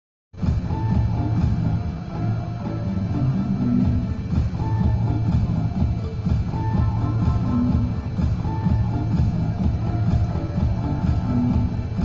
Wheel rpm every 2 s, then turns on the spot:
0, 0, 0, 0, 0, 0.
none